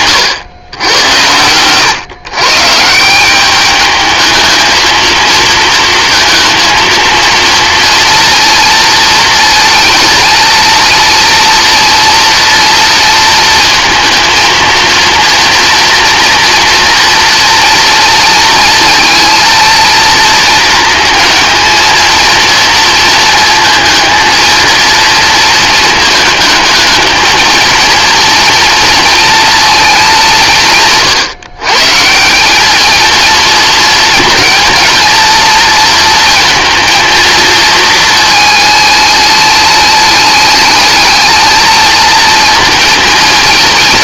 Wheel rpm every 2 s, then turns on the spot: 100, 160, 220, 230, 230, 230, 230, 230, 230, 230, 220, 230, 230, 220, 230, 120, 220, 230, 230, 210, 210, 230.
none